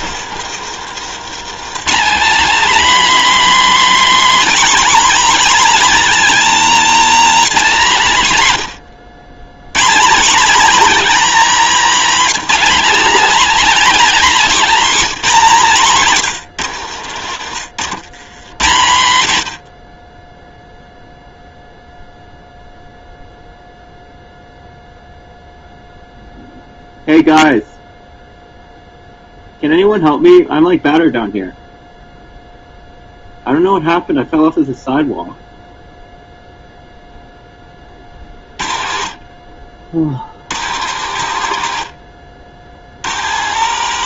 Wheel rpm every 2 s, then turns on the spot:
120, 270, 300, 280, 140, 280, 270, 270, 130, 130, 0, 0, 0, 0, 0, 0, 0, 0, 0, 40, 70, 60.
0-2 16-18 38-44